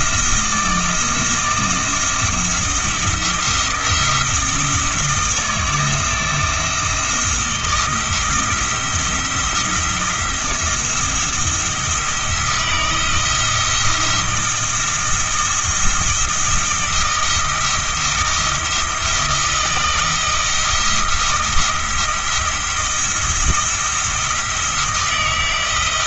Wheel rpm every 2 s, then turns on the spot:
170, 170, 160, 160, 170, 170, 160, 160, 160, 160, 160, 170, 170.
none